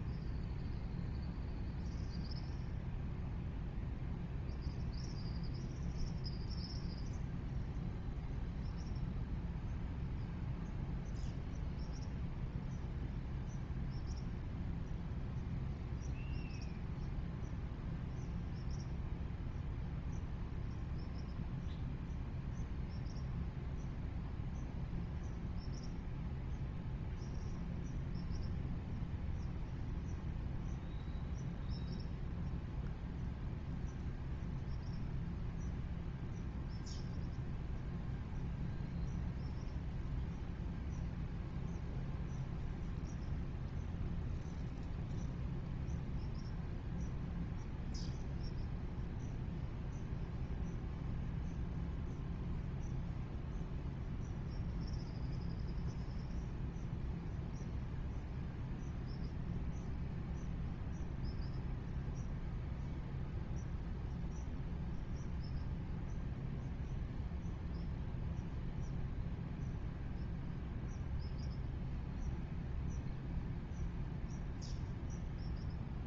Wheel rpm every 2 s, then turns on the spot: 0, 0, 0, 0, 0, 0, 0, 0, 0, 0, 0, 0, 0, 0, 0, 0, 0, 0, 0, 0, 0, 0, 0, 0, 0, 0, 0, 0, 0, 0, 0, 0, 0, 0, 0, 0, 0, 0.
none